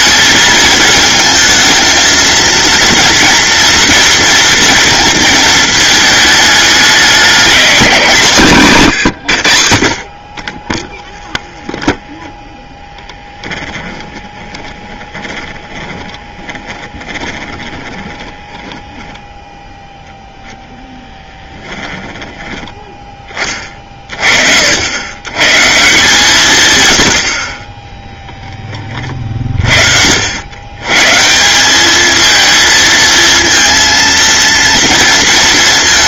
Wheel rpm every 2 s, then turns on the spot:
220, 230, 230, 200, 120, 10, 10, 20, 20, 20, 0, 10, 80, 100, 30, 120, 230, 230.
8-20